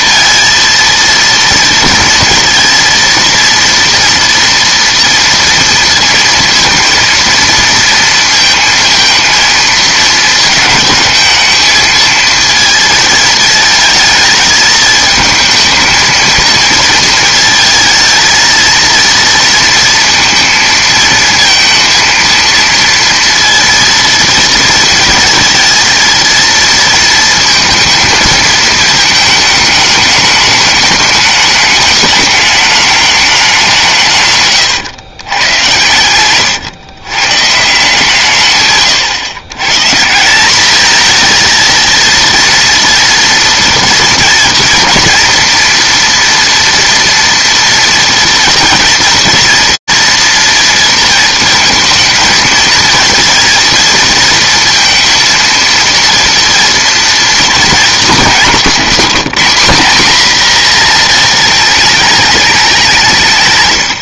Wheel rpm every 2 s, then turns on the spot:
230, 230, 230, 230, 230, 230, 230, 220, 230, 220, 230, 230, 230, 230, 220, 210, 210, 140, 110, 140, 190, 230, 240, 240, 220, 230, 220, 230, 240, 210, 240, 200.
34-36 58-60